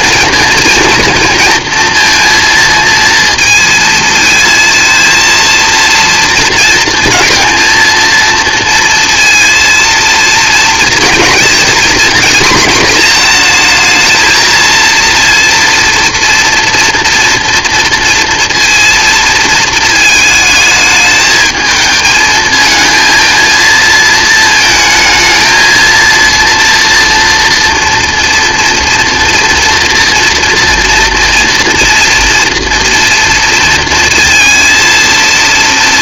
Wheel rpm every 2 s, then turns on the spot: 230, 230, 230, 220, 230, 230, 230, 230, 230, 230, 210, 220, 220, 230, 240, 230, 240, 230.
none